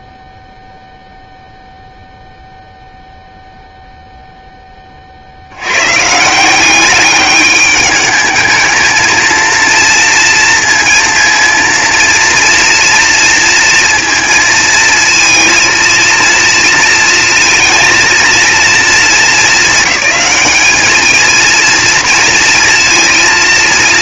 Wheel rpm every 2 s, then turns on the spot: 0, 0, 100, 210, 230, 230, 230, 230, 230, 200, 230, 230.
none